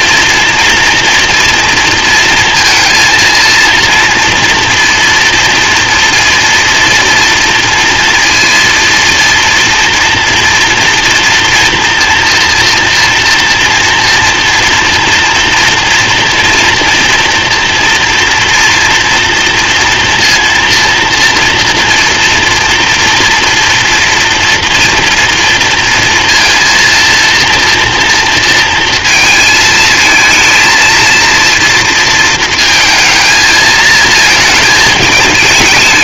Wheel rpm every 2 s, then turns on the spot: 240, 230, 230, 230, 230, 230, 230, 230, 240, 230, 230, 230, 230, 230, 230, 230, 220, 220.
none